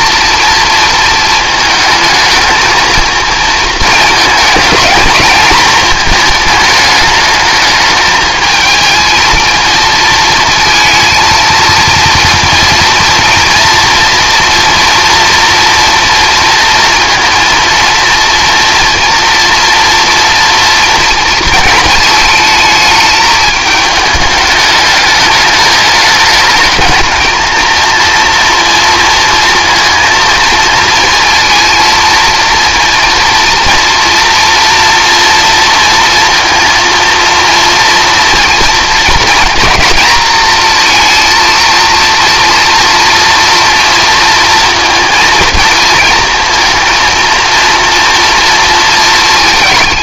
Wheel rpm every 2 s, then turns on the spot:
230, 220, 220, 220, 220, 230, 230, 230, 230, 230, 240, 220, 210, 220, 230, 230, 230, 240, 230, 230, 230, 230, 230, 230, 230.
none